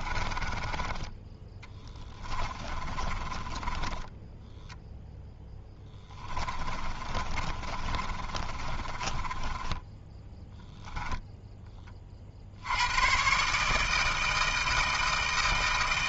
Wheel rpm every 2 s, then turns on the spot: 10, 20, 0, 20, 30, 0, 90, 160.
0-4 6-10